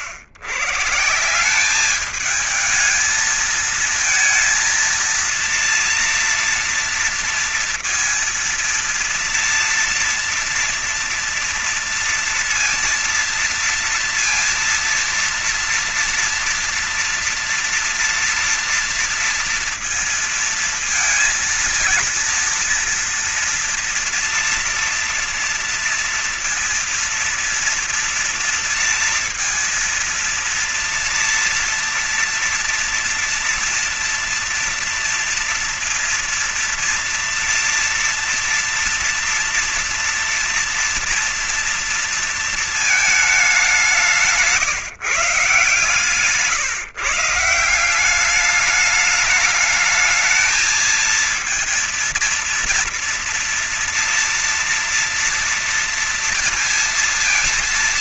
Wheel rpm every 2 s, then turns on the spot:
100, 210, 220, 230, 230, 230, 230, 230, 230, 230, 230, 230, 230, 230, 230, 230, 230, 230, 230, 230, 230, 230, 190, 140, 200, 220, 230, 230, 230.
none